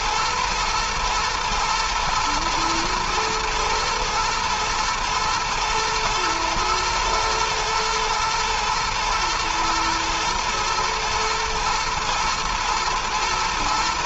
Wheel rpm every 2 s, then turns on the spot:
110, 110, 110, 120, 110, 110, 110.
none